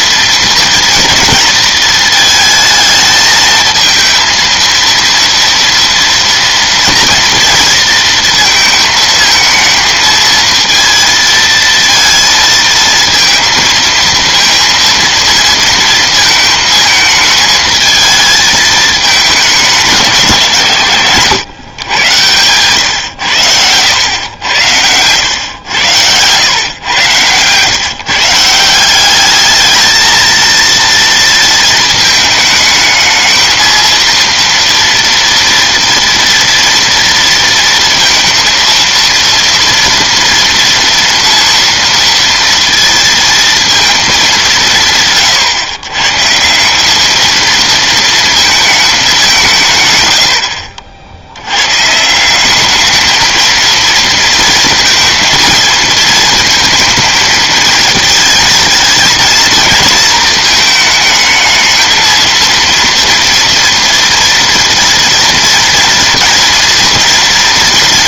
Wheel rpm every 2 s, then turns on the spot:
230, 220, 230, 230, 230, 230, 230, 230, 220, 220, 150, 120, 100, 110, 170, 230, 220, 240, 230, 230, 230, 230, 180, 170, 220, 80, 200, 230, 220, 220, 220, 230, 230, 230.
22-24